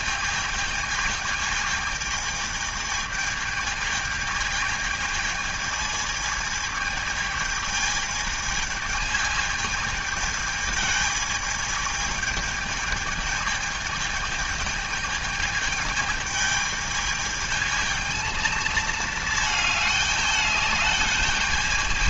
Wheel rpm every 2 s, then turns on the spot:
220, 220, 220, 220, 210, 220, 220, 220, 210, 220, 210.
none